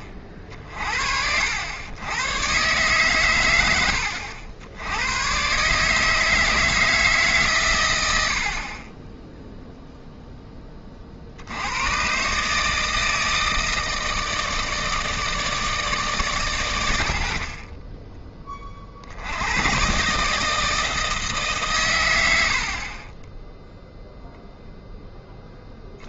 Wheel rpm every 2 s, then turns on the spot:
50, 130, 90, 160, 40, 20, 150, 160, 90, 50, 160, 50, 0.
none